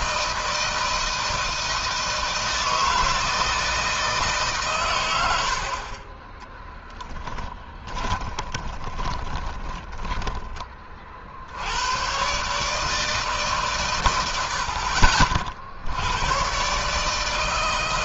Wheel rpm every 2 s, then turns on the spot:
160, 160, 140, 20, 20, 20, 130, 80, 110.
6-10